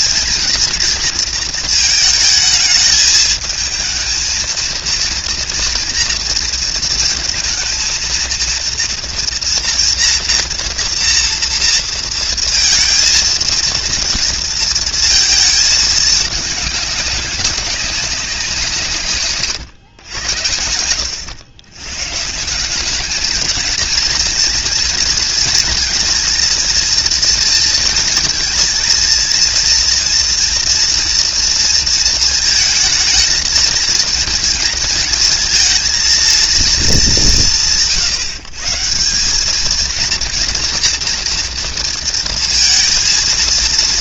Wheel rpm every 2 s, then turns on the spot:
230, 220, 230, 230, 230, 230, 230, 230, 200, 170, 80, 180, 230, 230, 230, 230, 220, 230, 230, 160, 230, 230.
none